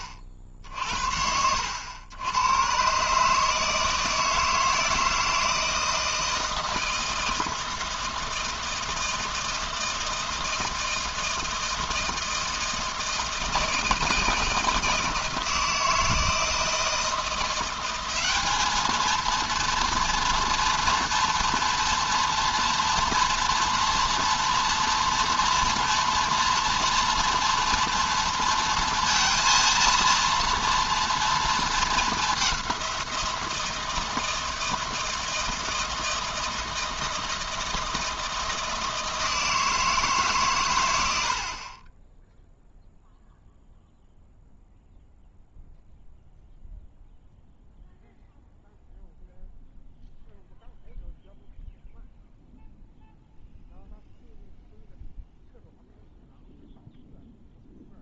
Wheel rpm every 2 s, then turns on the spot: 50, 130, 160, 160, 160, 160, 160, 160, 160, 220, 230, 240, 240, 230, 230, 230, 180, 160, 160, 160, 110, 0, 0, 0, 0, 0, 0, 0, 0.
none